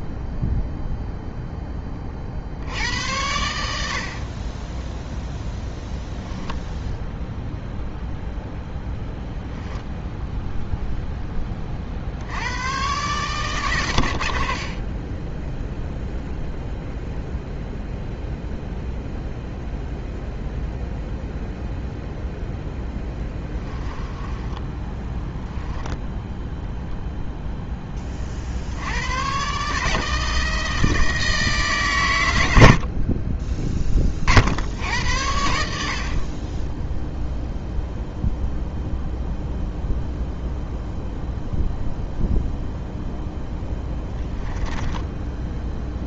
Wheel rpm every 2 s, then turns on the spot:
0, 80, 10, 0, 0, 0, 110, 30, 0, 0, 0, 0, 10, 0, 90, 160, 70, 80, 0, 0, 0, 0, 10.
4-6 24-26 44-46